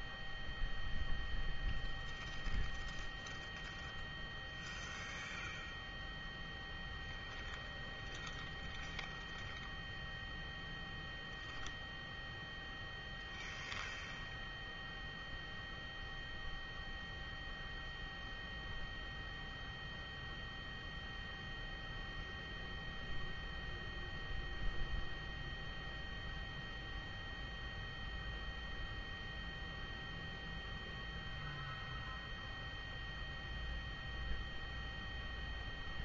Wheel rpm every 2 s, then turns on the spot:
0, 0, 0, 0, 0, 0, 0, 0, 0, 0, 0, 0, 0, 0, 0, 0, 0, 0.
none